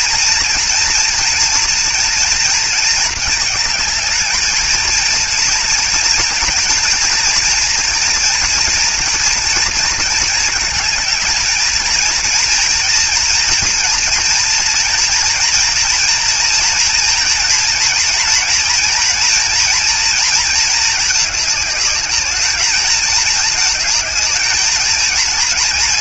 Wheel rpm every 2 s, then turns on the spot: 230, 230, 220, 230, 240, 220, 230, 230, 230, 230, 220, 210, 220.
none